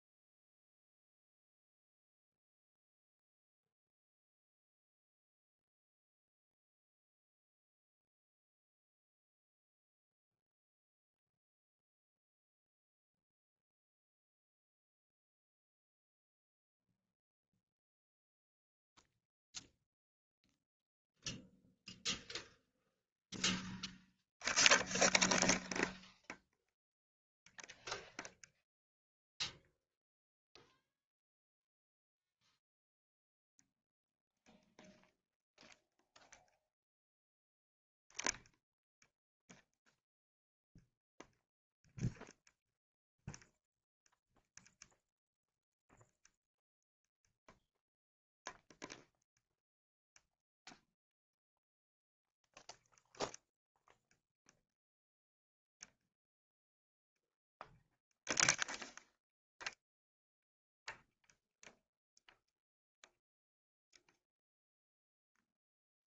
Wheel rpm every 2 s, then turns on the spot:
0, 0, 0, 0, 0, 0, 0, 0, 0, 0, 0, 0, 0, 0, 0, 0, 0, 0, 0, 0, 0, 0, 0, 0, 0, 0, 0, 0, 0, 0, 0, 0, 0.
none